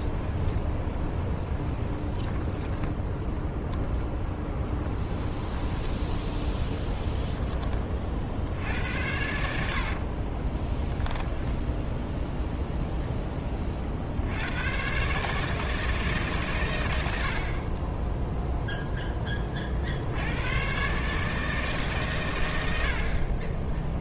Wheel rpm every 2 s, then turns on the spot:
30, 10, 20, 10, 70, 10, 0, 130, 100, 10, 140, 60.
0-2 4-8 10-12